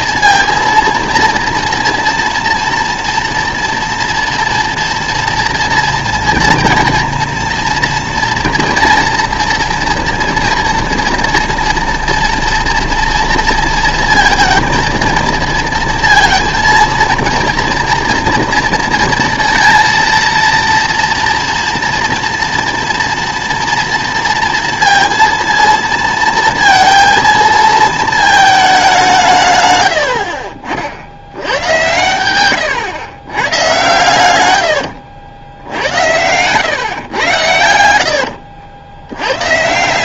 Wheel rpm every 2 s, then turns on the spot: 230, 230, 230, 230, 230, 230, 240, 230, 230, 230, 230, 230, 230, 230, 210, 50, 110, 110, 120, 70.
34-36